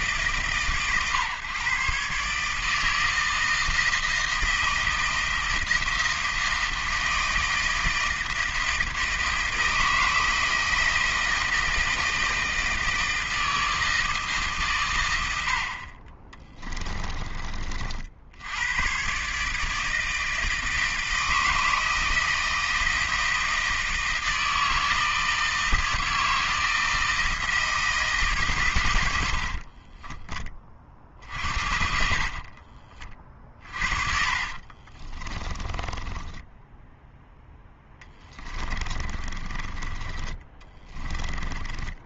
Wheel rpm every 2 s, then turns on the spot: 140, 160, 160, 160, 160, 160, 160, 130, 20, 110, 160, 160, 160, 160, 110, 30, 40, 40, 0, 30, 20.
16-18 32-36 38-42